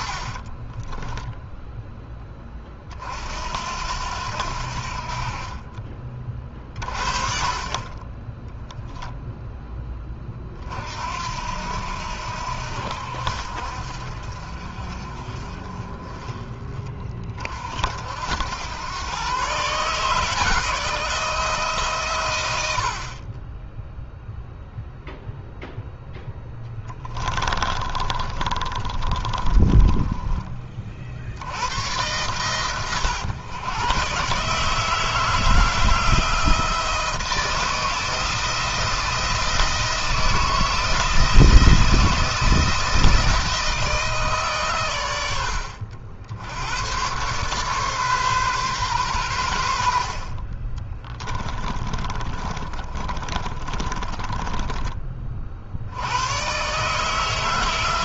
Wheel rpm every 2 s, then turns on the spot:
20, 30, 60, 40, 10, 50, 70, 50, 30, 110, 160, 70, 0, 10, 30, 40, 110, 150, 160, 160, 160, 160, 120, 100, 120, 30, 30, 20, 130.
0-2 8-10 28-30 50-54